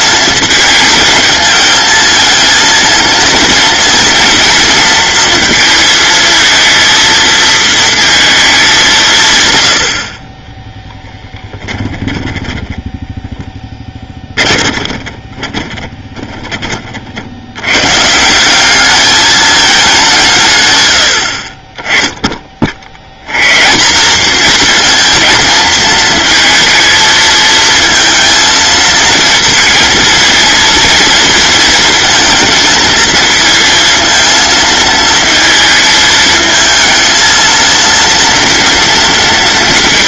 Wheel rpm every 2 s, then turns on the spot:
220, 220, 230, 230, 180, 10, 10, 30, 40, 210, 100, 90, 230, 220, 220, 230, 230, 230, 220, 230.
10-16